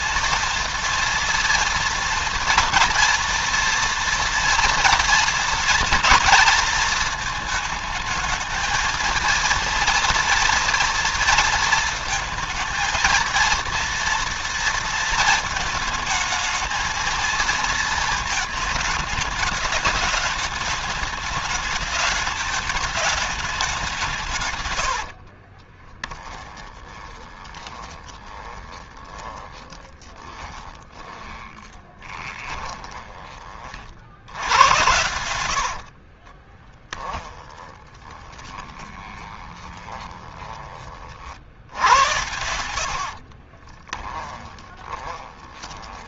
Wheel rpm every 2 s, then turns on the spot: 230, 240, 230, 220, 230, 230, 230, 230, 220, 220, 210, 210, 100, 20, 20, 20, 20, 100, 20, 20, 30, 70, 20.
24-40 42-46